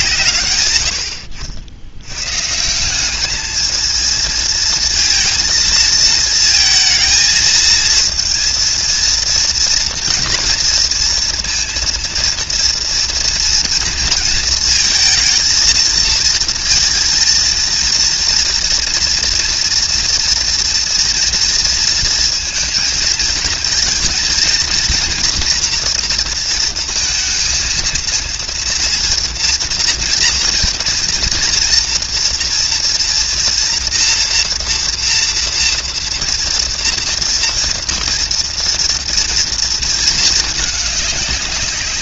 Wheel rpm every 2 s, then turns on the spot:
80, 180, 230, 230, 230, 230, 230, 230, 230, 230, 230, 230, 230, 230, 230, 230, 230, 240, 230, 230, 210.
none